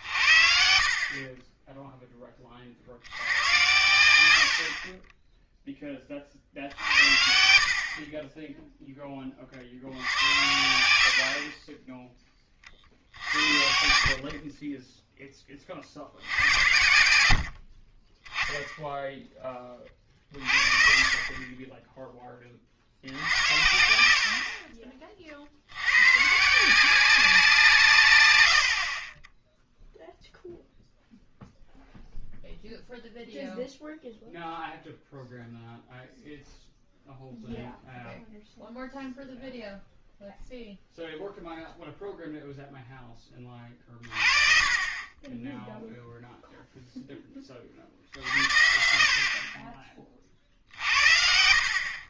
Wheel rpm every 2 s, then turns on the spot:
60, 40, 70, 60, 10, 90, 30, 30, 80, 10, 50, 40, 40, 160, 80, 0, 0, 0, 0, 0, 0, 0, 30, 0, 60, 50.
10-12